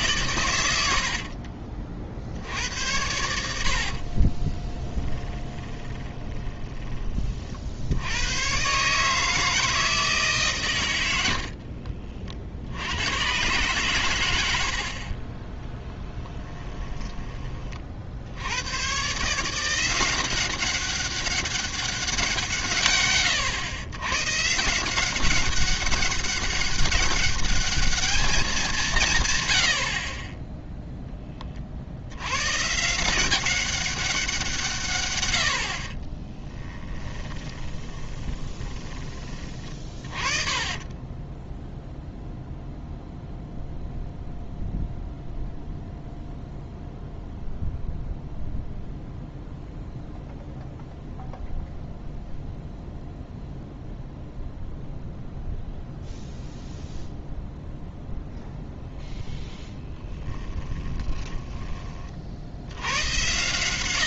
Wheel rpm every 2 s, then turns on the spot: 80, 90, 10, 20, 140, 100, 90, 60, 10, 120, 190, 130, 170, 200, 170, 10, 150, 130, 10, 20, 20, 0, 0, 0, 0, 0, 0, 0, 0, 0, 10, 100.
2-6 36-38 40-42 60-62